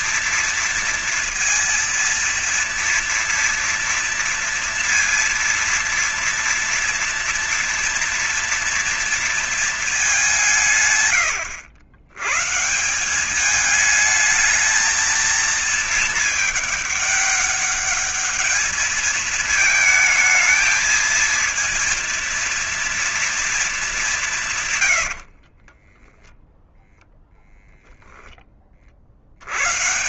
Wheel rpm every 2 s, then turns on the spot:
230, 230, 230, 230, 230, 170, 140, 220, 220, 210, 220, 230, 170, 10, 30.
24-28